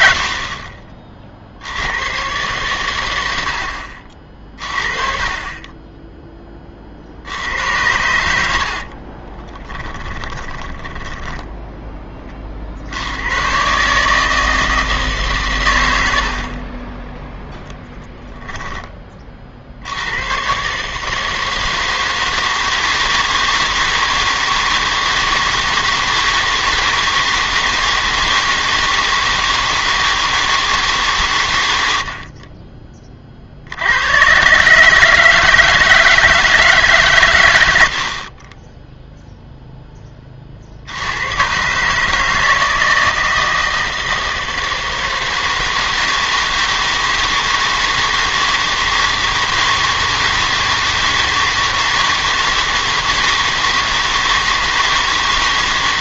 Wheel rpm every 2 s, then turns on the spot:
50, 120, 40, 20, 60, 10, 50, 160, 40, 10, 130, 160, 160, 160, 160, 160, 40, 140, 160, 20, 40, 160, 160, 160, 160, 160, 160, 160.
8-12